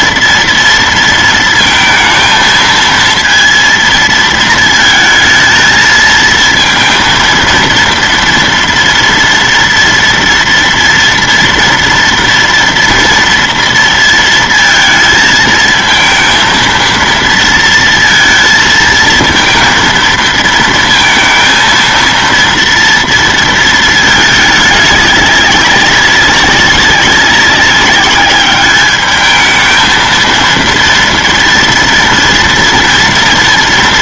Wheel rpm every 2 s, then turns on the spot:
230, 230, 230, 230, 230, 230, 230, 220, 230, 230, 230, 230, 210, 190, 210, 230, 230.
none